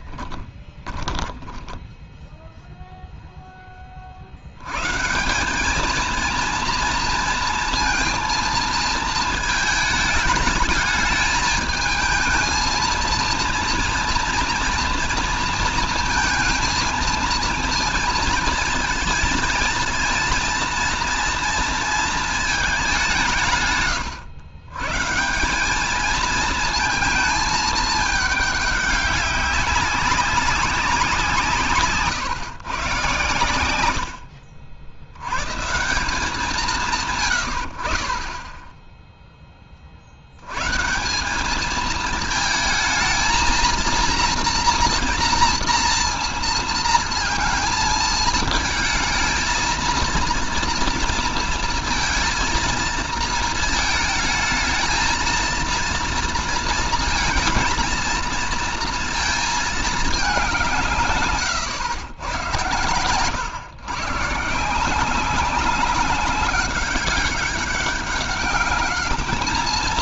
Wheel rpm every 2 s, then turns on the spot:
10, 0, 140, 230, 230, 220, 230, 230, 230, 220, 230, 190, 120, 220, 200, 180, 120, 70, 160, 10, 100, 220, 240, 230, 220, 230, 230, 220, 230, 230, 170, 100, 160, 190, 210.
0-2